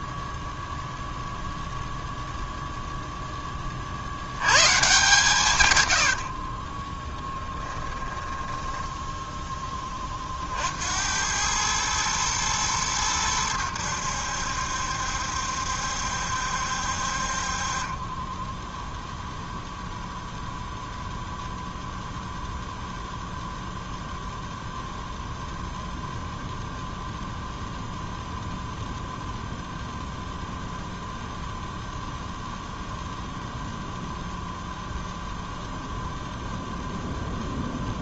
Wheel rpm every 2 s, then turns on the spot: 0, 0, 120, 40, 10, 60, 110, 70, 70, 10, 0, 0, 0, 0, 0, 0, 0, 0, 0.
6-10